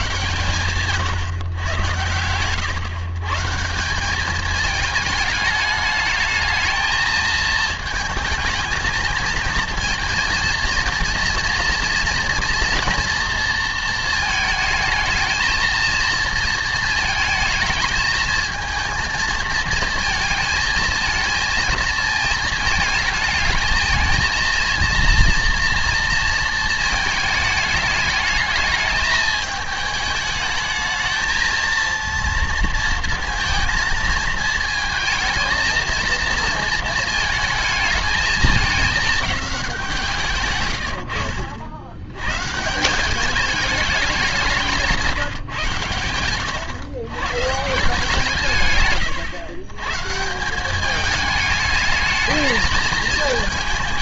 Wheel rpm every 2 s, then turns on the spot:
120, 110, 210, 220, 220, 230, 230, 220, 230, 230, 220, 220, 230, 230, 220, 220, 230, 220, 220, 220, 130, 130, 190, 120, 150, 180, 210.
none